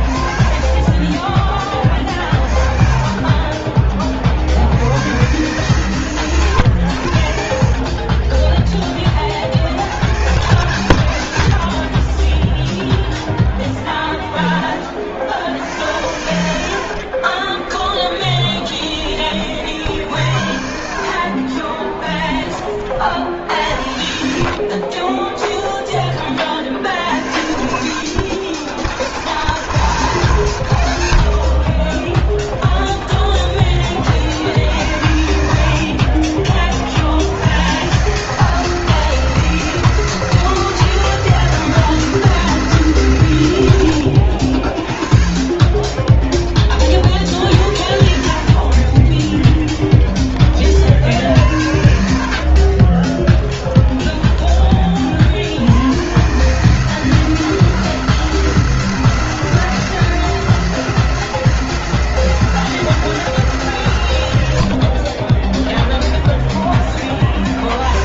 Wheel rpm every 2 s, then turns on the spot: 40, 30, 90, 100, 20, 110, 0, 20, 70, 40, 60, 30, 50, 60, 100, 110, 20, 70, 40, 160, 160, 160, 50, 30, 40, 50, 30, 30, 150, 160, 160, 160, 60, 20.
0-4 16-22 24-26 32-34 44-46 48-50 52-54 64-66